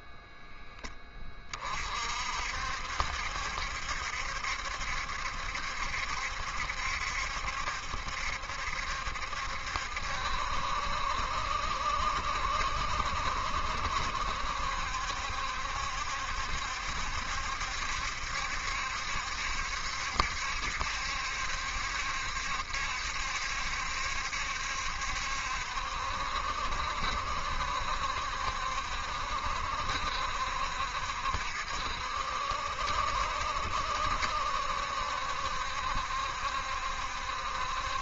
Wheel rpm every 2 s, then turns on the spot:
10, 60, 70, 70, 70, 70, 70, 70, 70, 70, 70, 70, 70, 70, 70, 70, 70, 70, 70.
none